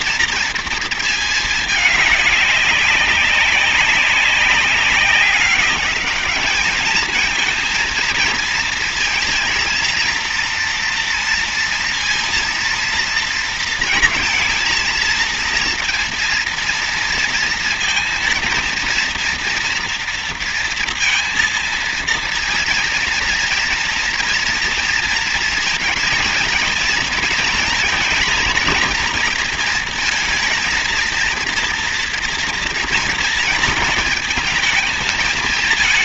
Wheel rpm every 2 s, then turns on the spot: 230, 210, 190, 210, 230, 230, 230, 230, 230, 230, 230, 230, 230, 230, 240, 230, 230, 220.
none